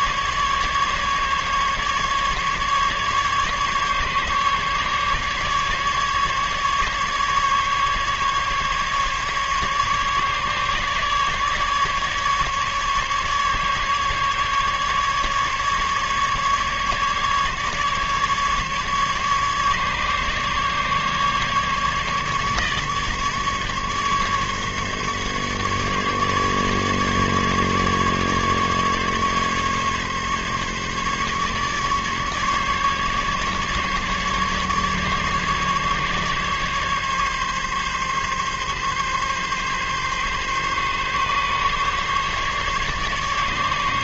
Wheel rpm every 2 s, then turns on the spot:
150, 150, 140, 140, 150, 150, 150, 150, 150, 150, 140, 150, 140, 150, 140, 140, 140, 150, 140, 140, 140, 140.
none